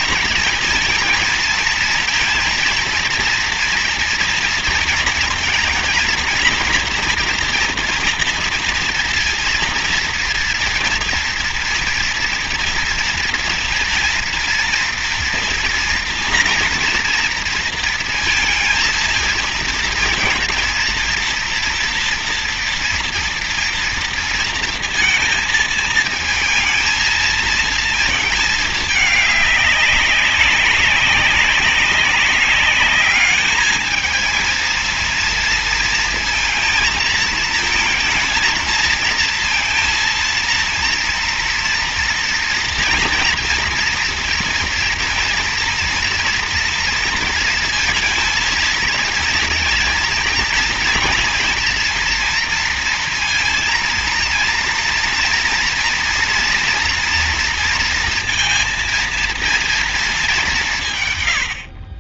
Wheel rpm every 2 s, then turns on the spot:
230, 230, 230, 240, 230, 230, 230, 240, 230, 230, 230, 230, 230, 230, 210, 200, 210, 230, 220, 220, 230, 230, 230, 230, 230, 230, 230, 230, 230, 230, 130.
none